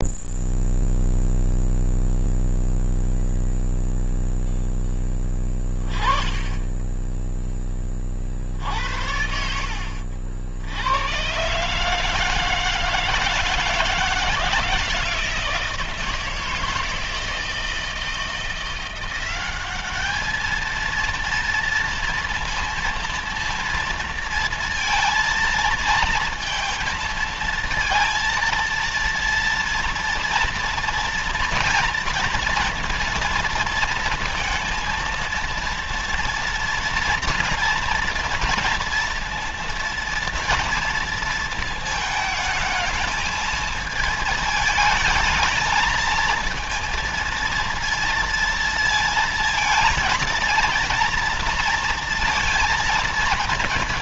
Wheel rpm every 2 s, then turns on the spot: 0, 0, 0, 10, 60, 70, 160, 160, 160, 170, 220, 230, 230, 230, 230, 230, 230, 230, 230, 230, 230, 220, 220, 220, 230, 230, 230.
none